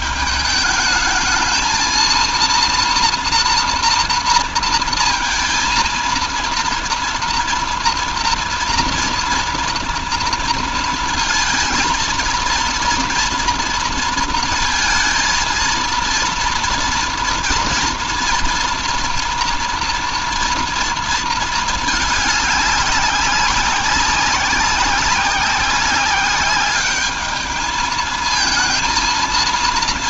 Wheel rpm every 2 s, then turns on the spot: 220, 230, 230, 230, 230, 230, 230, 230, 230, 230, 230, 200, 190, 200, 220.
none